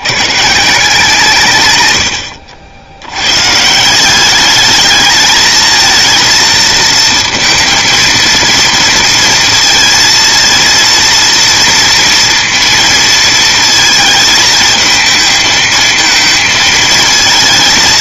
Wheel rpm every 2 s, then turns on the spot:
160, 70, 210, 230, 230, 230, 230, 220, 220.
none